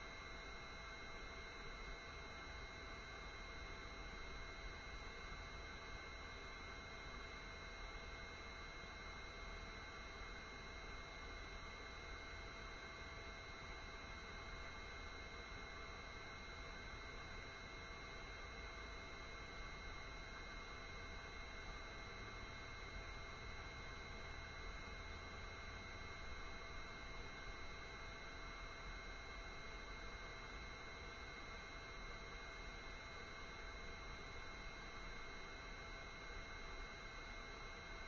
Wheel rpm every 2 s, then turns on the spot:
0, 0, 0, 0, 0, 0, 0, 0, 0, 0, 0, 0, 0, 0, 0, 0, 0, 0, 0.
none